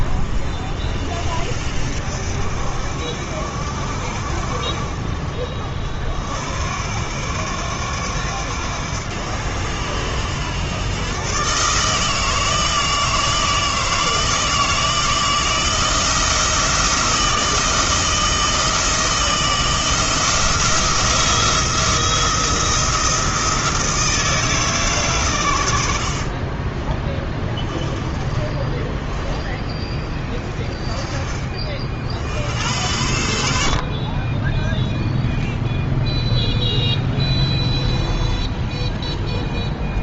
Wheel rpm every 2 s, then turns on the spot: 50, 60, 50, 70, 90, 110, 160, 160, 160, 160, 170, 170, 150, 20, 20, 20, 90, 0, 0, 0.
26-30